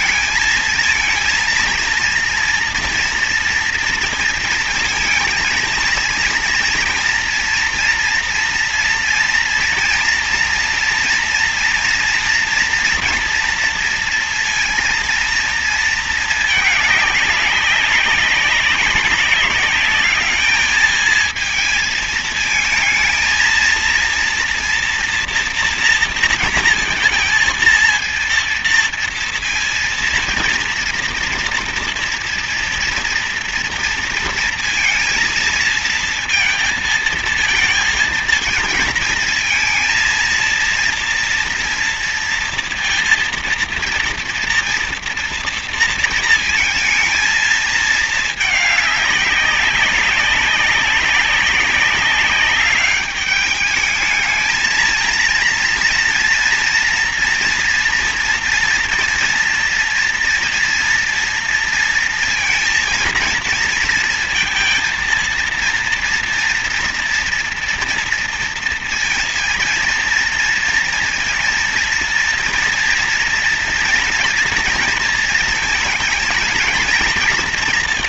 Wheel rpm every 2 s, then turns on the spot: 220, 230, 230, 230, 230, 230, 230, 230, 210, 190, 220, 220, 230, 230, 230, 230, 230, 230, 230, 220, 230, 230, 240, 220, 210, 190, 200, 220, 230, 230, 230, 230, 230, 230, 230, 230, 230, 230, 230.
none